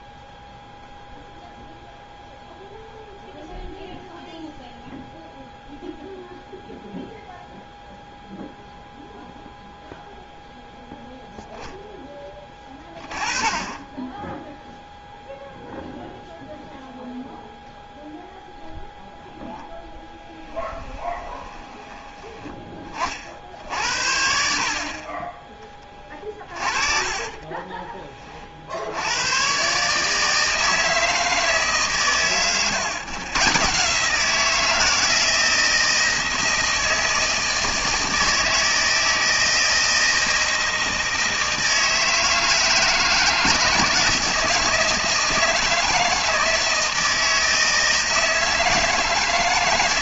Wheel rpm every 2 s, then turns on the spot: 0, 0, 0, 0, 0, 0, 20, 0, 0, 0, 10, 20, 50, 30, 50, 160, 120, 170, 160, 160, 160, 160, 160, 160, 160.
20-22 26-28